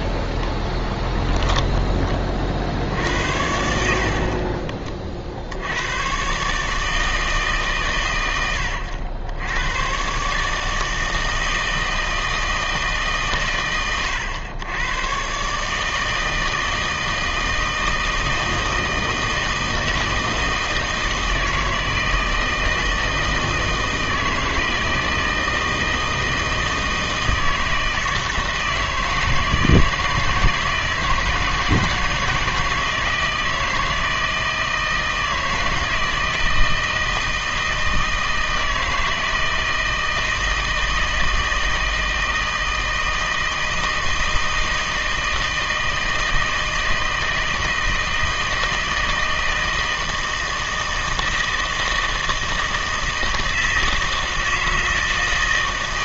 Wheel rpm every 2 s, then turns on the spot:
0, 60, 30, 150, 80, 150, 150, 110, 160, 160, 160, 160, 160, 160, 160, 160, 160, 160, 160, 160, 160, 160, 160, 160, 160, 160, 160, 160.
none